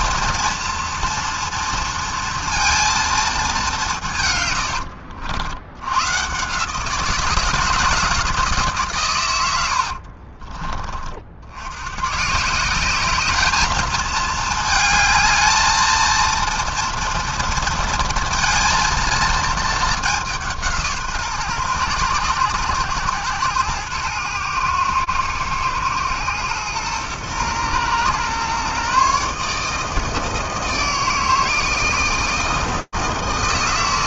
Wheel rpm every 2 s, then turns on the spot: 230, 230, 100, 140, 150, 30, 170, 220, 230, 230, 180, 120, 110, 120, 130, 160, 160.
4-6